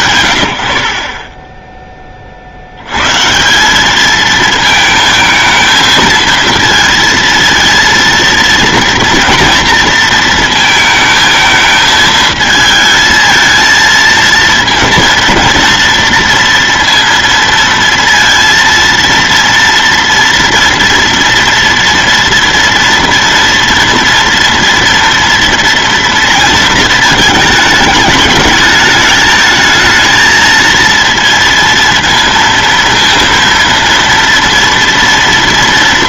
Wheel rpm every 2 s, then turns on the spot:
100, 90, 220, 230, 230, 220, 220, 230, 230, 230, 230, 230, 230, 230, 220, 230, 230, 230.
none